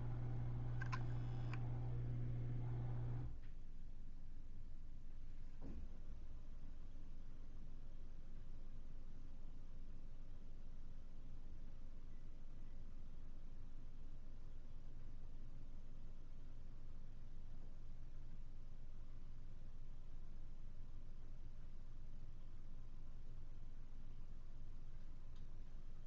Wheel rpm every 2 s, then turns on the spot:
0, 0, 0, 0, 0, 0, 0, 0, 0, 0, 0, 0, 0.
none